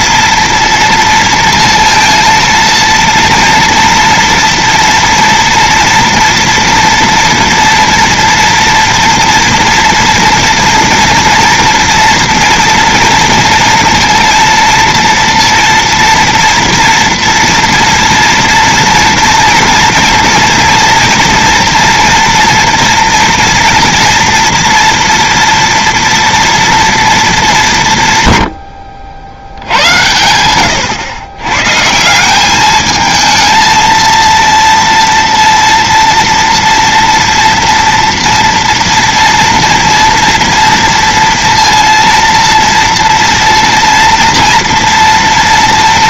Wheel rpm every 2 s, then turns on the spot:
230, 230, 230, 230, 230, 230, 230, 230, 230, 230, 230, 230, 230, 240, 100, 100, 190, 230, 230, 230, 230, 230, 230.
30-32